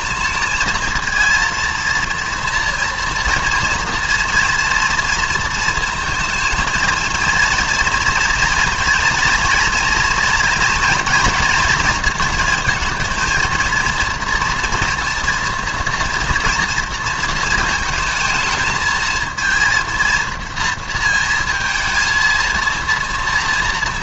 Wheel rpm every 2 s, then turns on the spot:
230, 230, 230, 230, 230, 240, 230, 230, 230, 220, 230, 230.
none